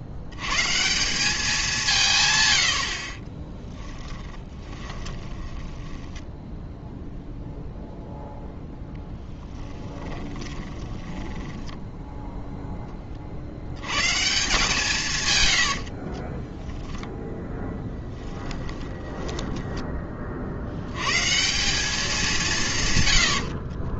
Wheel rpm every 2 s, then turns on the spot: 120, 100, 20, 0, 0, 20, 10, 160, 10, 20, 60, 160.
4-6 10-12 16-20